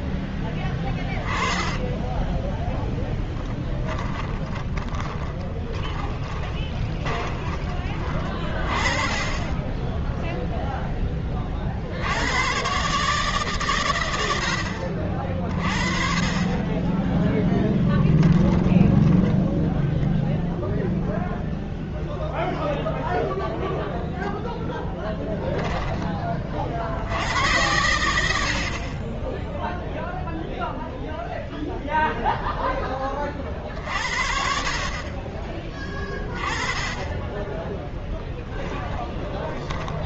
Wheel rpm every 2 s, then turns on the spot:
10, 10, 30, 20, 30, 10, 140, 60, 30, 10, 0, 0, 0, 70, 40, 0, 10, 40, 20, 10.
0-2 4-8 18-20 38-40